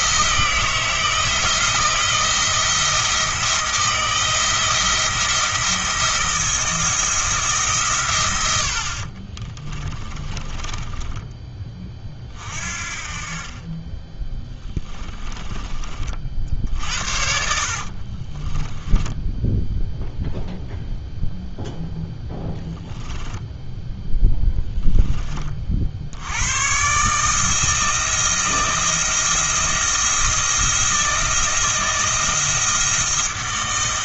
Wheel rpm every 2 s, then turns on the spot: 160, 170, 160, 170, 60, 30, 40, 20, 60, 10, 0, 10, 10, 130, 170, 170, 170.
10-12 14-16 18-20 22-24